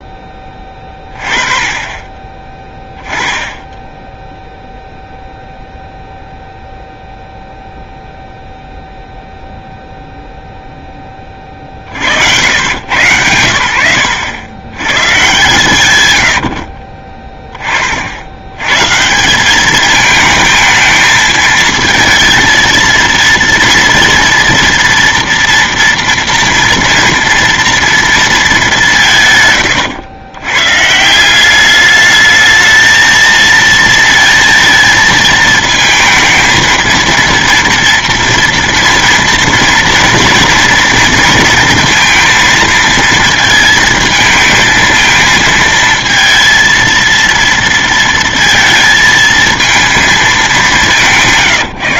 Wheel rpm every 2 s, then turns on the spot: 20, 10, 0, 0, 0, 0, 100, 110, 70, 120, 220, 230, 230, 230, 210, 130, 220, 230, 230, 230, 230, 230, 220, 230, 230, 210.
none